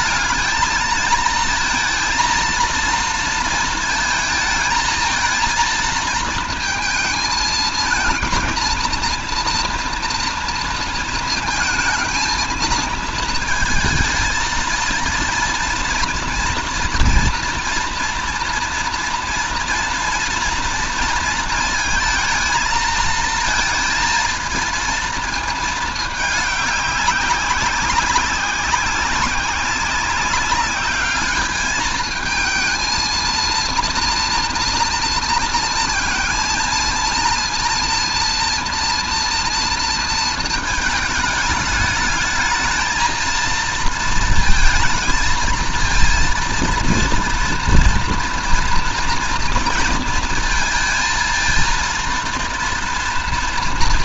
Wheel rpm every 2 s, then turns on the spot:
210, 230, 230, 230, 230, 230, 220, 230, 230, 230, 230, 220, 230, 200, 190, 200, 220, 230, 230, 230, 220, 220, 230, 230, 230, 230, 230.
none